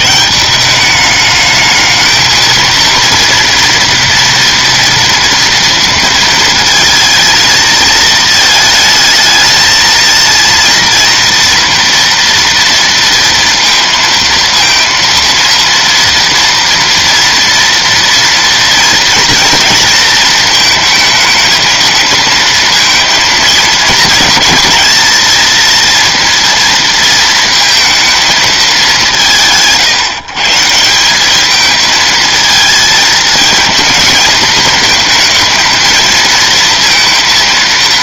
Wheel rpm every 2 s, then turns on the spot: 180, 230, 230, 220, 220, 230, 230, 230, 230, 230, 230, 230, 230, 230, 210, 160, 220, 220, 230.
none